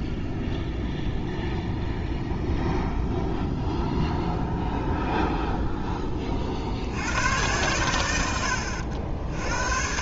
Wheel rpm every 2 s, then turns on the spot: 0, 0, 0, 80, 80.
none